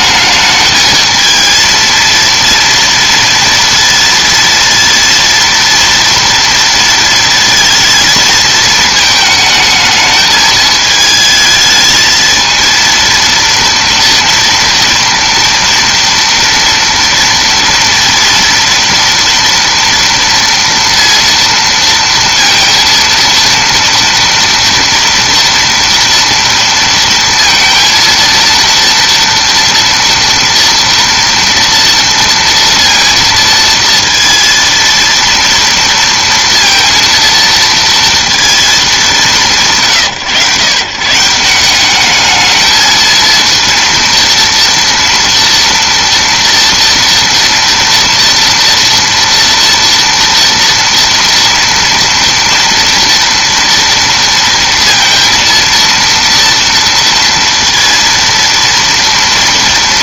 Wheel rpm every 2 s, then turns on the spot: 220, 230, 230, 230, 220, 220, 230, 230, 230, 230, 230, 230, 230, 230, 230, 230, 230, 230, 230, 220, 120, 220, 230, 230, 230, 230, 230, 230, 230, 230.
none